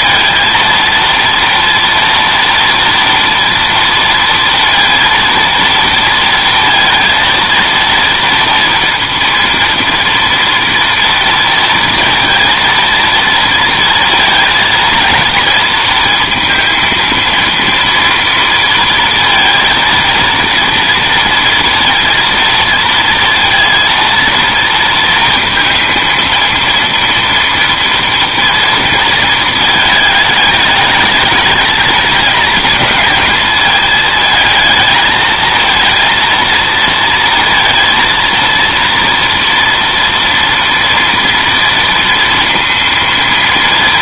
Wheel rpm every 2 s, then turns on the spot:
230, 230, 230, 230, 230, 230, 230, 230, 230, 230, 230, 230, 230, 230, 230, 210, 220, 220, 230, 230, 230, 230.
none